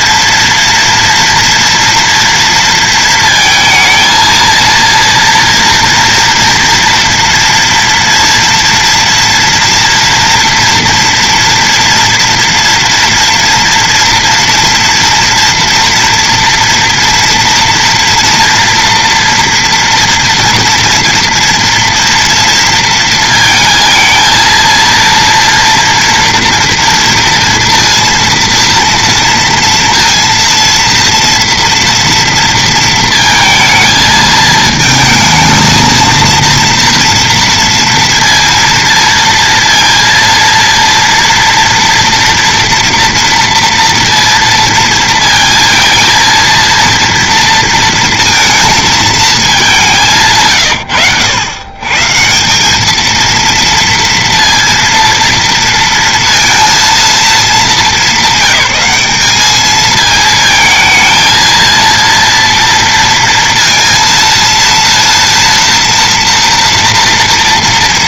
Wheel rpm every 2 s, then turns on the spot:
230, 230, 230, 230, 230, 230, 230, 230, 230, 230, 240, 230, 230, 230, 230, 230, 230, 220, 230, 230, 230, 230, 230, 230, 230, 140, 160, 230, 230, 200, 220, 230, 230, 230.
none